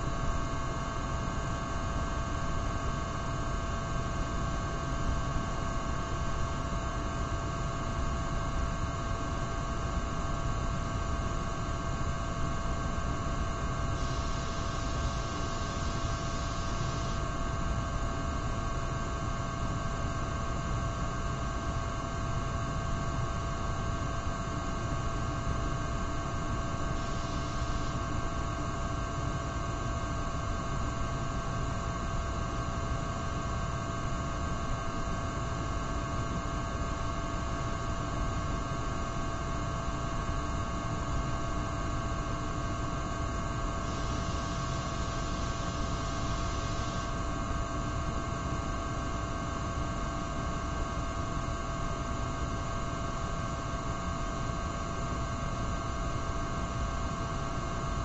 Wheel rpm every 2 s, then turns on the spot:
0, 0, 0, 0, 0, 0, 0, 0, 0, 0, 0, 0, 0, 0, 0, 0, 0, 0, 0, 0, 0, 0, 0, 0, 0, 0, 0, 0, 0.
none